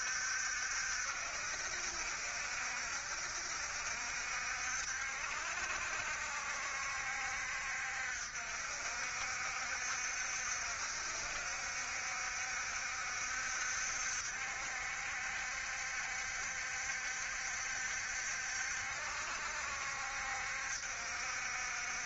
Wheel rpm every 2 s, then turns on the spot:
70, 60, 70, 60, 70, 60, 70, 60, 70, 70, 60.
none